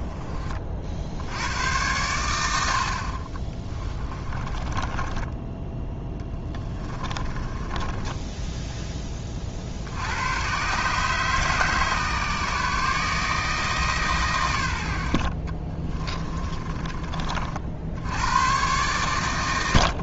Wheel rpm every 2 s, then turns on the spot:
40, 70, 20, 10, 10, 130, 150, 110, 20, 110.
4-8 16-18